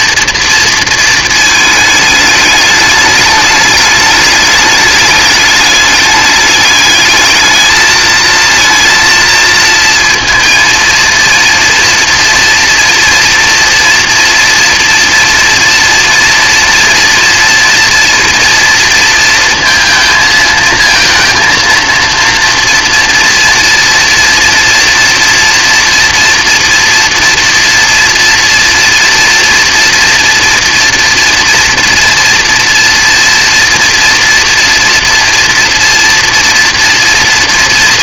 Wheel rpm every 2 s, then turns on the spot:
230, 210, 210, 210, 230, 230, 230, 240, 230, 230, 230, 240, 240, 230, 230, 240, 230, 230, 240.
none